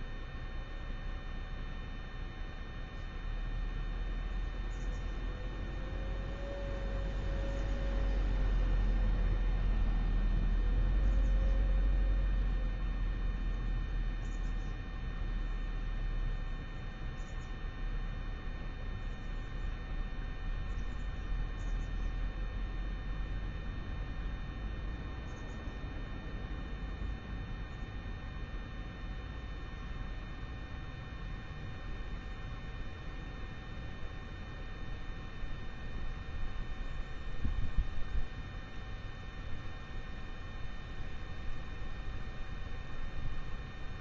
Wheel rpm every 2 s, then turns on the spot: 0, 0, 0, 0, 0, 0, 0, 0, 0, 0, 0, 0, 0, 0, 0, 0, 0, 0, 0, 0, 0, 0.
none